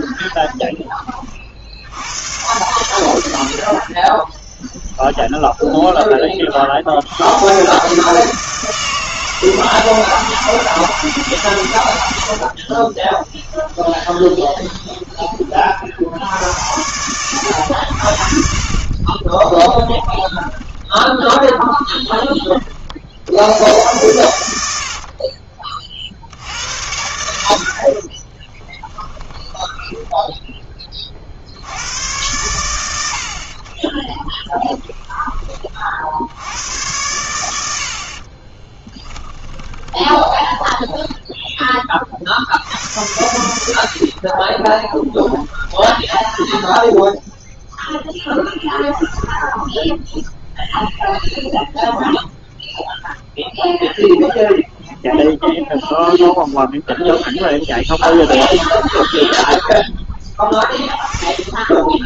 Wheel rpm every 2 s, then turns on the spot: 10, 110, 10, 50, 160, 160, 50, 20, 100, 50, 10, 30, 80, 80, 20, 10, 100, 10, 90, 20, 10, 60, 30, 10, 0, 0, 0, 0, 0, 10, 10.
4-6 12-16 20-22 28-32 34-36 38-42 44-48